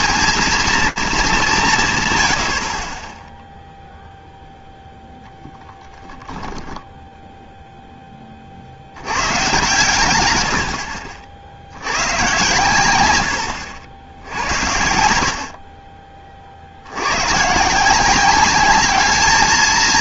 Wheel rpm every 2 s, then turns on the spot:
230, 50, 0, 10, 90, 60, 110, 70, 90, 210.
none